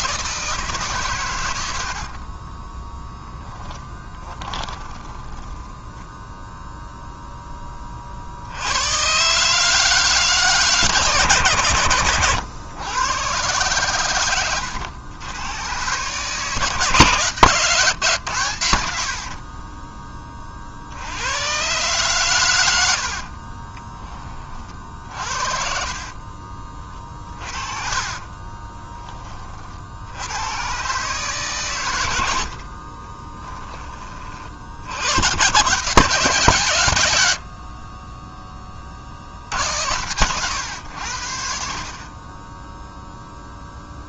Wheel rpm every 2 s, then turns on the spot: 150, 10, 20, 0, 90, 150, 110, 100, 150, 80, 60, 90, 40, 30, 30, 120, 40, 60, 110, 20, 110, 0.
2-6 22-26 28-30 32-34